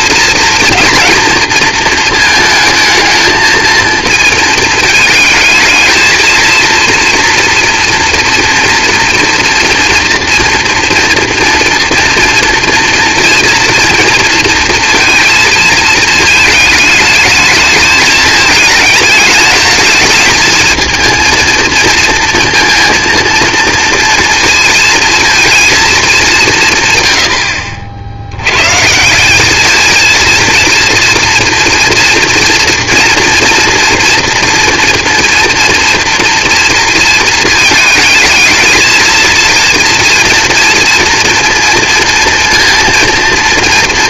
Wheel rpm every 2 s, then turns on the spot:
230, 220, 220, 230, 230, 230, 230, 230, 220, 210, 220, 230, 230, 160, 120, 230, 240, 230, 230, 220, 230, 230.
none